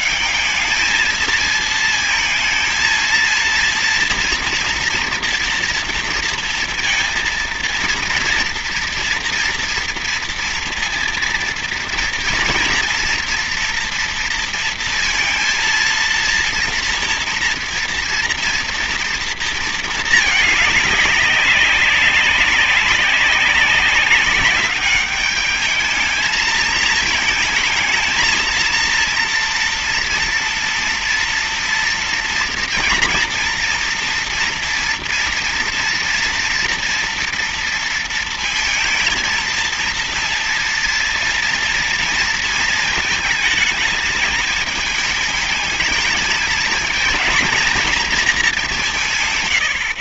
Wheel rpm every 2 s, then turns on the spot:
210, 230, 230, 230, 230, 230, 230, 230, 230, 230, 210, 190, 200, 220, 230, 230, 230, 230, 240, 230, 230, 220, 210, 230, 200.
none